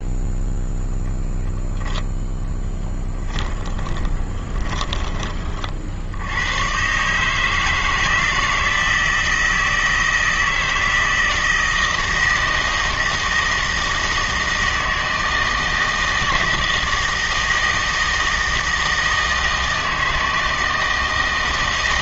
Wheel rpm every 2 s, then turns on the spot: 0, 10, 20, 130, 160, 160, 160, 160, 160, 160, 160.
2-6